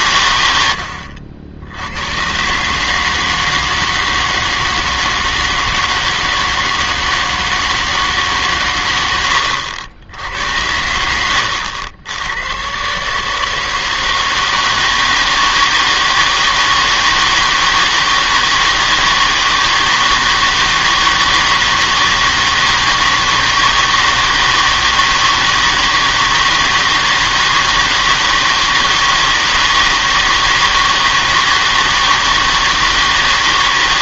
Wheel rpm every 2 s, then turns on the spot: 90, 140, 160, 160, 110, 80, 110, 160, 160, 160, 160, 160, 160, 160, 160, 160, 160.
none